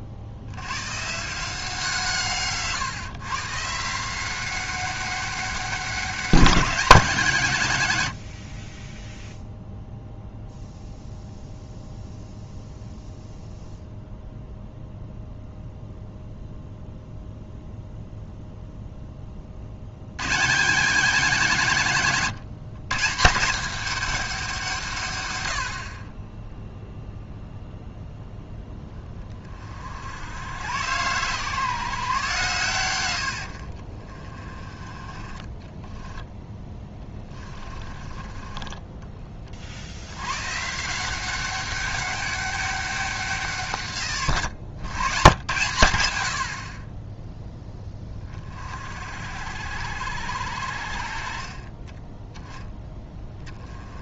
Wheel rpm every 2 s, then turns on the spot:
130, 130, 190, 190, 20, 0, 0, 0, 0, 10, 190, 160, 150, 0, 10, 110, 100, 30, 10, 20, 160, 200, 110, 30, 50, 60, 10.
36-40